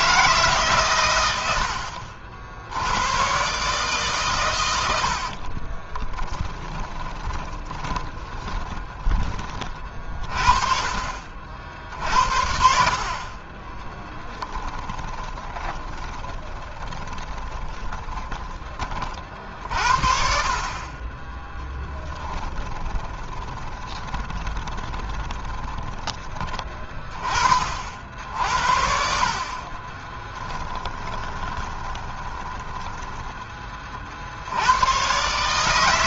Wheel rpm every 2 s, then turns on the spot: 130, 100, 70, 20, 20, 40, 40, 20, 20, 30, 30, 20, 20, 30, 60, 20, 10, 100.
4-8 14-18 22-26 28-34